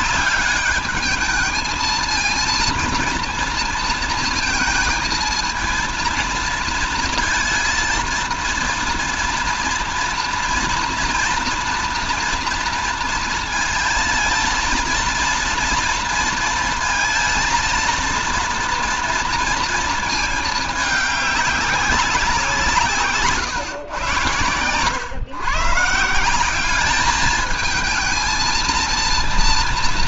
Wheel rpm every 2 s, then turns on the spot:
210, 230, 230, 230, 230, 230, 230, 230, 230, 230, 210, 170, 120, 190, 230.
none